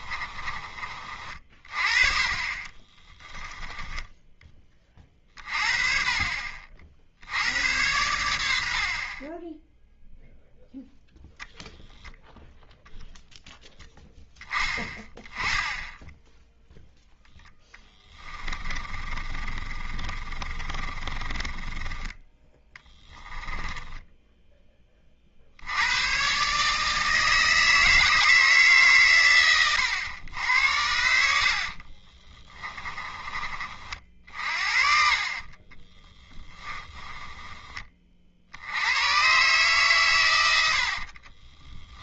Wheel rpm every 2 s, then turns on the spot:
30, 20, 30, 50, 70, 0, 0, 10, 0, 30, 30, 10, 20, 150, 140, 80, 20, 60, 10, 90, 50.
2-4 18-24 34-38 40-42